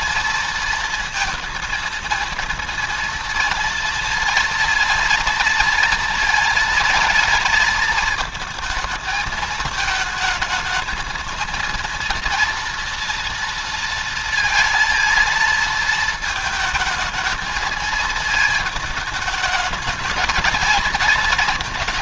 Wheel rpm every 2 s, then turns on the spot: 230, 230, 230, 230, 220, 220, 230, 220, 220, 220, 220.
none